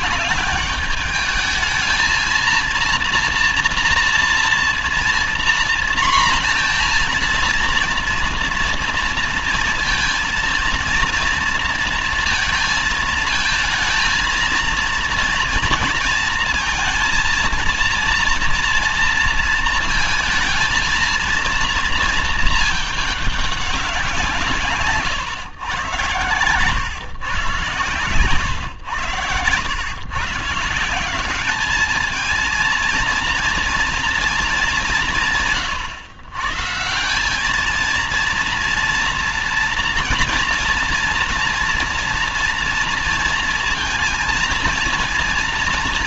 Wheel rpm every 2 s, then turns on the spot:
210, 230, 230, 240, 230, 230, 230, 230, 220, 230, 230, 220, 140, 130, 110, 160, 230, 210, 150, 230, 230, 230, 230.
none